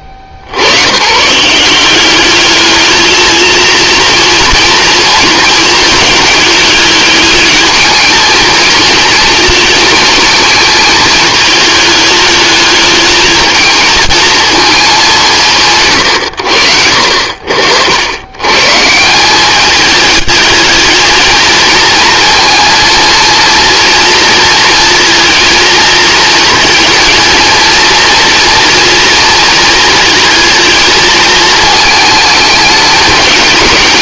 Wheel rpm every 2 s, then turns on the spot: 70, 220, 220, 210, 230, 220, 220, 180, 70, 160, 220, 230, 230, 230, 230, 220, 210.
none